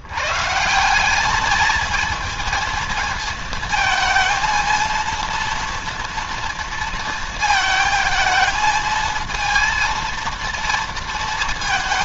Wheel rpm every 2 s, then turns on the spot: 150, 220, 230, 230, 220, 220.
none